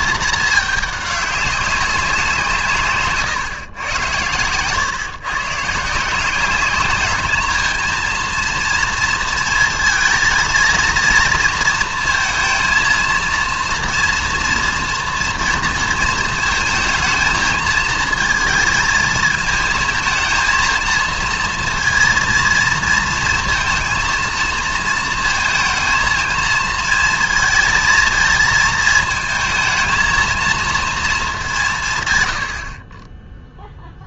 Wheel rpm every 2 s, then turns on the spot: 210, 150, 120, 200, 230, 230, 230, 230, 220, 220, 230, 230, 230, 230, 220, 230, 60.
none